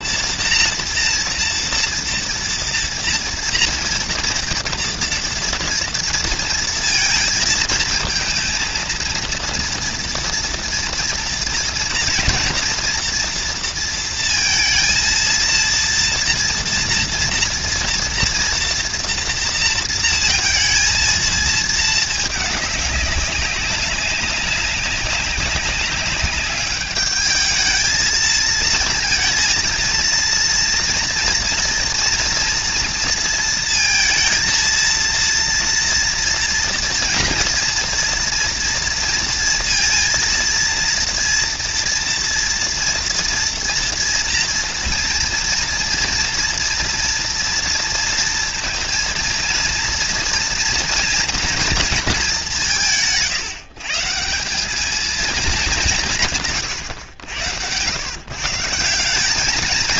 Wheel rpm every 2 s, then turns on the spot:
230, 230, 230, 230, 230, 230, 230, 230, 230, 230, 230, 210, 190, 200, 220, 230, 230, 230, 230, 230, 230, 230, 230, 230, 230, 240, 190, 200, 130, 170.
none